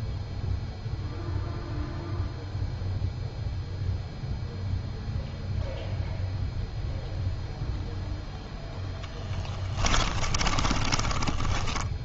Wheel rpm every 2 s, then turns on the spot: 0, 0, 0, 0, 0, 20.
10-12